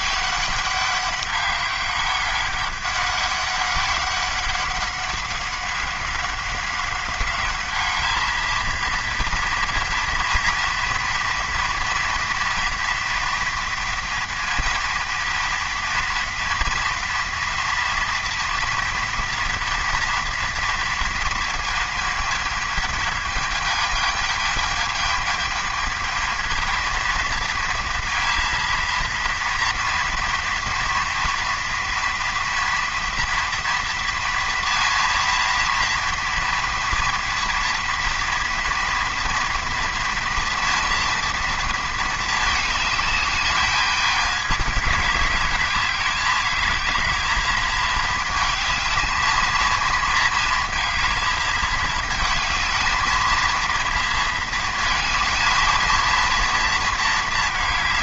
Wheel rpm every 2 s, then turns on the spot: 200, 200, 190, 190, 230, 230, 230, 230, 230, 230, 230, 220, 210, 230, 230, 230, 230, 230, 230, 240, 230, 210, 210, 210, 220, 230, 220, 230, 230.
none